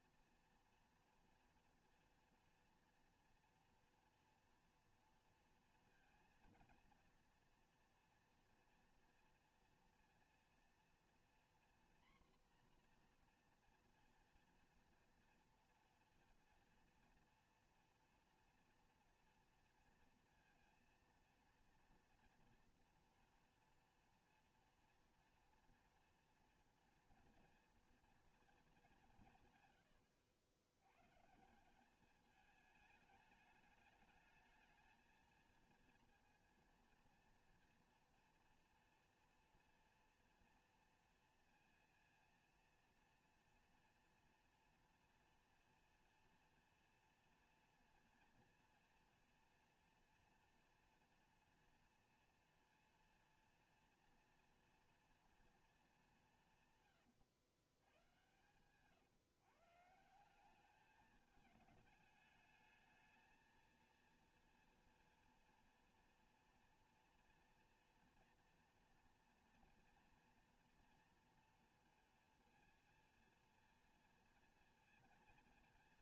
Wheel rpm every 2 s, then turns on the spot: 230, 230, 230, 230, 230, 230, 240, 230, 240, 240, 230, 230, 230, 230, 220, 90, 210, 220, 230, 230, 230, 230, 230, 230, 230, 230, 230, 230, 150, 120, 190, 220, 230, 240, 230, 230, 240, 230.
none